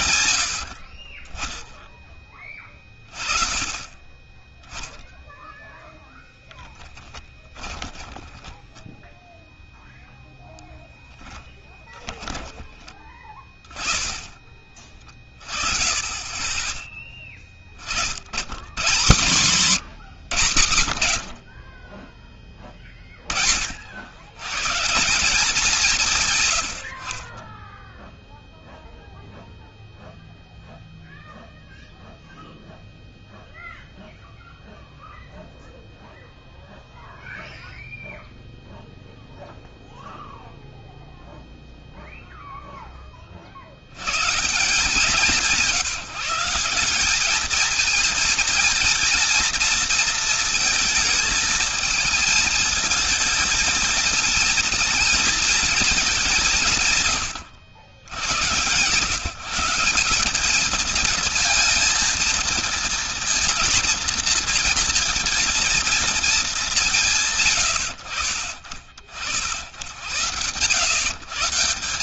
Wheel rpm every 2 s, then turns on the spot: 70, 40, 10, 10, 10, 10, 10, 30, 20, 120, 110, 20, 150, 100, 0, 0, 0, 0, 0, 0, 0, 20, 180, 180, 230, 220, 220, 220, 150, 120, 220, 230, 230, 190, 40, 120.
6-12